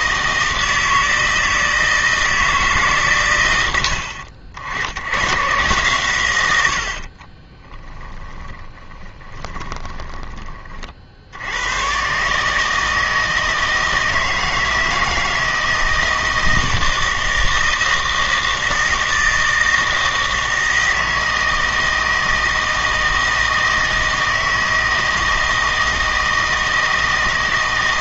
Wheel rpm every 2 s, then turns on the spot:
160, 150, 70, 80, 20, 20, 150, 160, 160, 160, 160, 160, 160, 160.
8-10